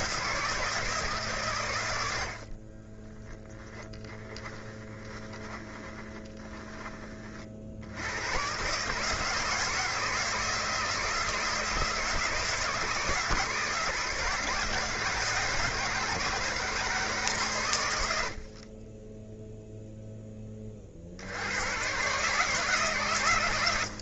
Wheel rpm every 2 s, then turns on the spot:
160, 30, 10, 20, 140, 160, 160, 160, 160, 40, 50, 150.
2-6